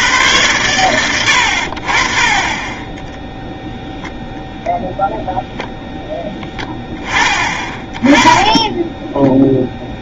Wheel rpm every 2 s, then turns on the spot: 100, 30, 0, 10, 20.
8-10